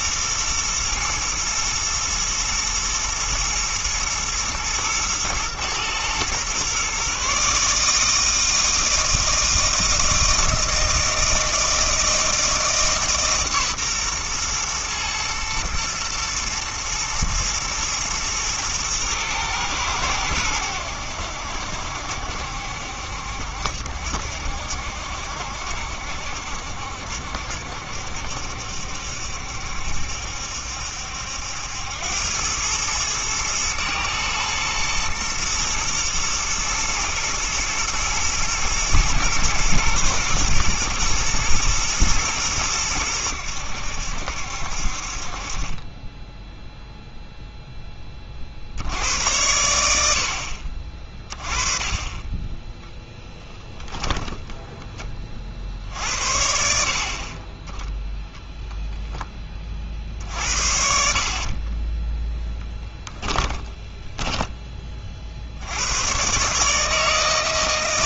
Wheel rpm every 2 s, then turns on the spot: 120, 110, 120, 130, 160, 160, 160, 120, 120, 110, 90, 70, 70, 70, 70, 70, 100, 110, 110, 110, 120, 110, 60, 0, 70, 40, 10, 10, 60, 0, 50, 10, 20, 150.
60-64